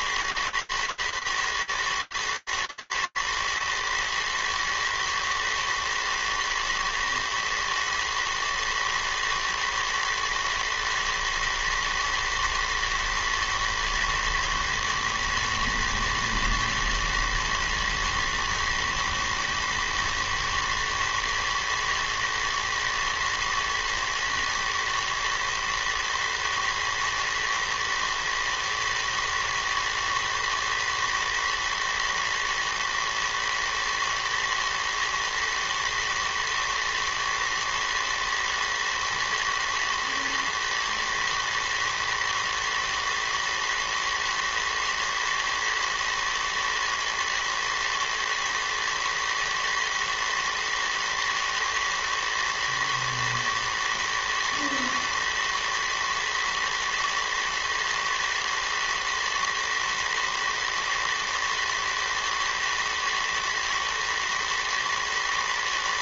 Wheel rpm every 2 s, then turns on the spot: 110, 110, 110, 110, 110, 120, 110, 110, 110, 110, 110, 110, 110, 110, 110, 110, 120, 110, 110, 110, 110, 110, 110, 110, 110, 110, 110, 110, 120, 120, 120, 110, 110.
none